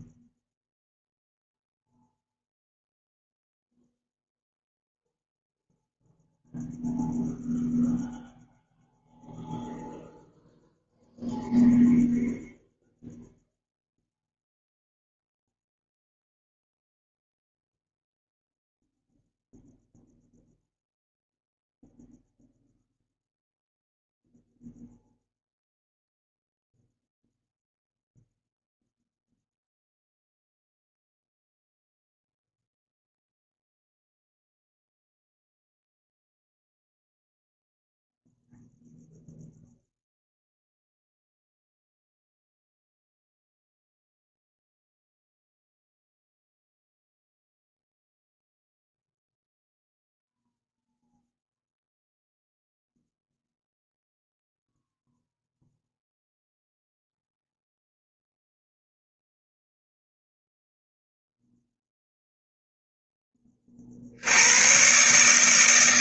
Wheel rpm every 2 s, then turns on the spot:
0, 0, 0, 0, 0, 0, 0, 0, 0, 0, 0, 0, 0, 0, 0, 0, 0, 0, 0, 0, 0, 0, 0, 0, 0, 0, 0, 0, 0, 0, 0, 10, 130.
none